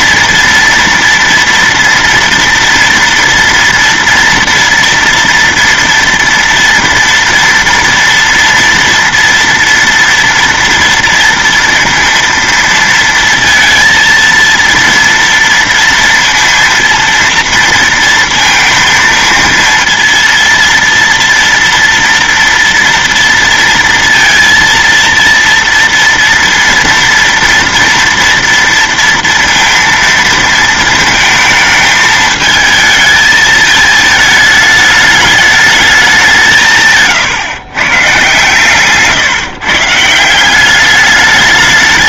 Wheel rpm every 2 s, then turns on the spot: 230, 230, 230, 230, 230, 230, 230, 230, 230, 230, 230, 230, 230, 230, 230, 230, 220, 210, 160, 130, 200.
none